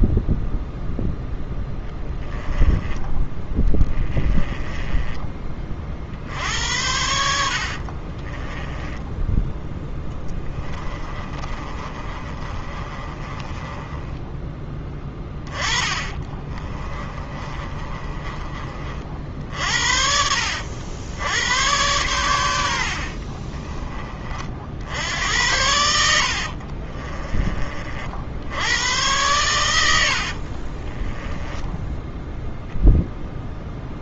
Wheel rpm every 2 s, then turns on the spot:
0, 10, 20, 70, 10, 30, 30, 10, 30, 40, 70, 60, 70, 40, 100, 30, 0.
2-6 8-14 16-18 26-28 30-32